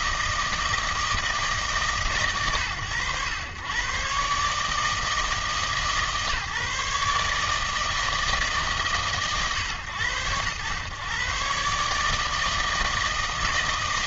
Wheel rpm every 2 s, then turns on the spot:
160, 130, 150, 150, 150, 110, 160.
none